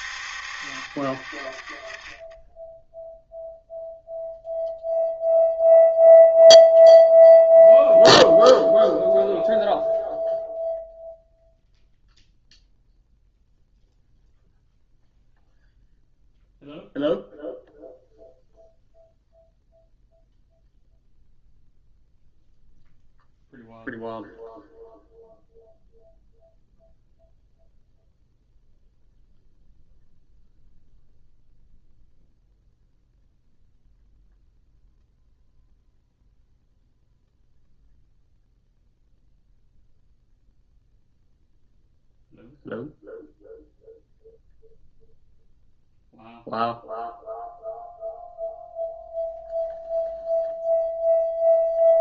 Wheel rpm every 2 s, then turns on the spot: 60, 10, 0, 0, 0, 0, 0, 0, 0, 0, 0, 0, 0, 0, 0, 0, 0, 0, 0, 0, 0, 0, 0, 0, 0, 0.
none